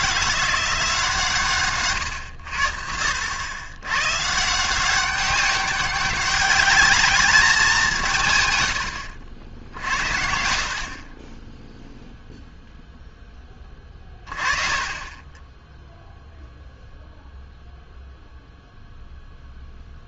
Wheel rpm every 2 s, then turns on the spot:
170, 70, 170, 210, 110, 70, 0, 30, 0, 0.
14-16